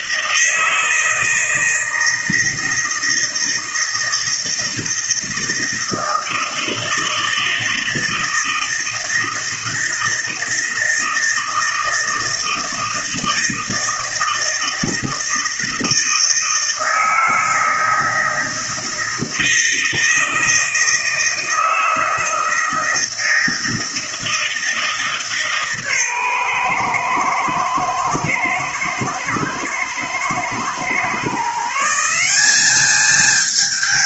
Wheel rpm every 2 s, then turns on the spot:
160, 160, 160, 160, 160, 160, 160, 160, 160, 160, 160, 160, 160, 120, 110, 130, 210.
none